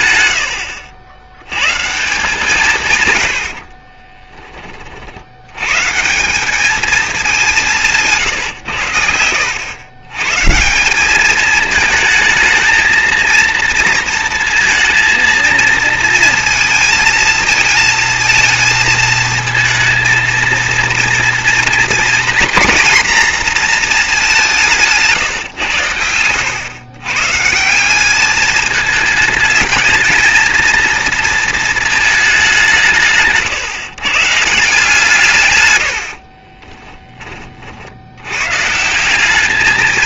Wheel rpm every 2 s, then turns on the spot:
80, 120, 70, 200, 80, 210, 230, 220, 220, 230, 230, 240, 150, 140, 220, 230, 150, 160, 20, 180.
36-38